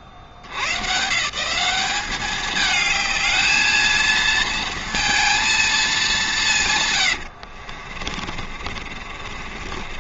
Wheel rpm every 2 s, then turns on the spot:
70, 210, 230, 150, 50.
8-10